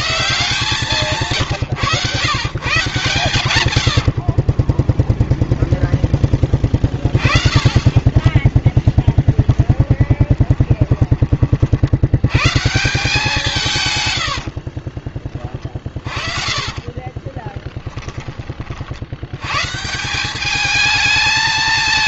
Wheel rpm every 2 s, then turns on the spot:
140, 130, 10, 30, 10, 20, 150, 30, 30, 60, 210.
4-6 8-10 14-18